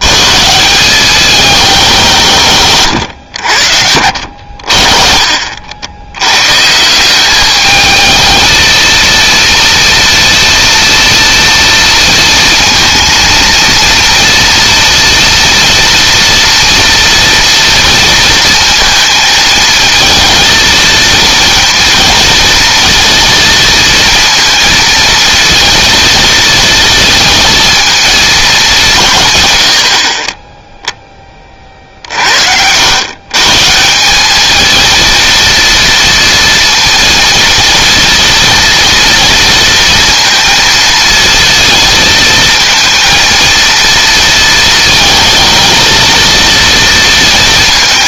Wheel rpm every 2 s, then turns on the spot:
170, 130, 60, 150, 230, 230, 230, 230, 230, 230, 230, 230, 230, 230, 190, 10, 100, 220, 230, 230, 230, 230, 220, 230.
none